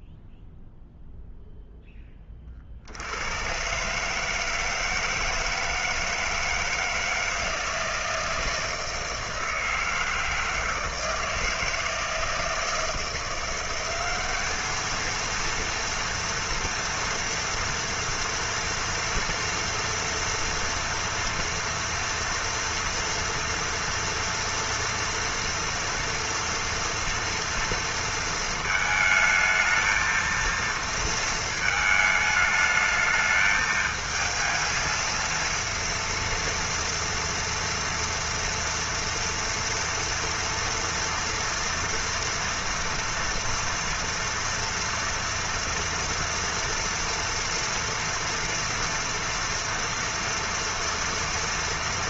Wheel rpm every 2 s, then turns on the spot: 0, 40, 160, 160, 160, 160, 160, 210, 230, 230, 230, 230, 230, 240, 220, 230, 220, 220, 230, 230, 230, 240, 240, 230, 240, 230.
none